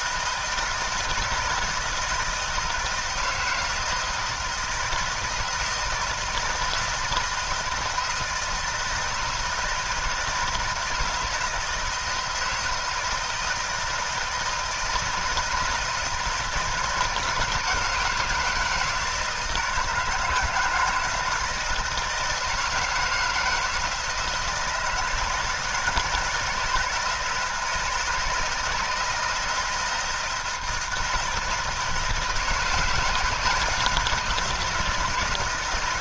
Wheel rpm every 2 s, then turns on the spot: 160, 160, 160, 160, 160, 160, 160, 160, 160, 160, 160, 160, 160, 160, 160, 160, 160, 170.
none